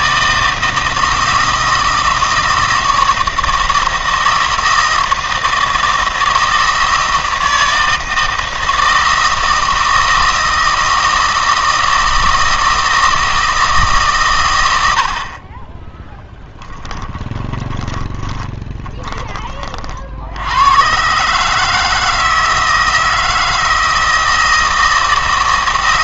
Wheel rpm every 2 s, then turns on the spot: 160, 160, 160, 160, 160, 160, 160, 90, 10, 10, 110, 160, 160.
16-18